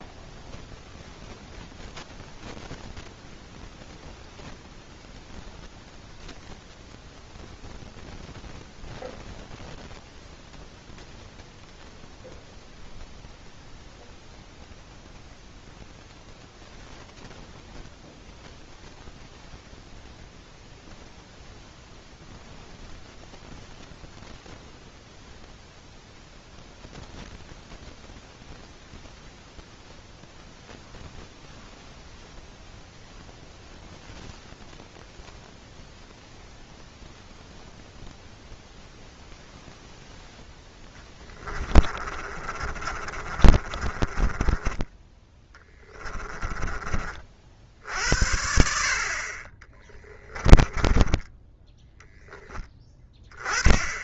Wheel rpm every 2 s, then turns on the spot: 0, 0, 0, 0, 0, 0, 0, 0, 0, 0, 0, 0, 0, 0, 0, 0, 0, 0, 0, 0, 10, 30, 10, 30, 60, 10, 10.
40-46 50-52